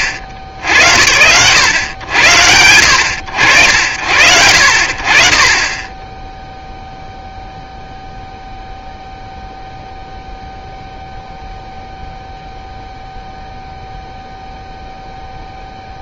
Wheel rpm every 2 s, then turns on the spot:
80, 80, 70, 0, 0, 0, 0, 0.
none